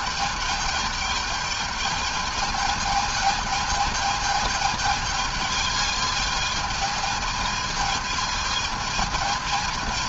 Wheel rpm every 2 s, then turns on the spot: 210, 220, 220, 220, 220.
none